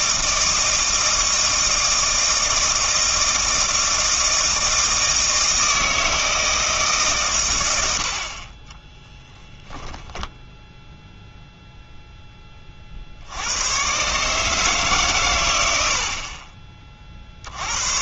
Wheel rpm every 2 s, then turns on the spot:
160, 160, 160, 150, 20, 10, 40, 150, 30.
8-10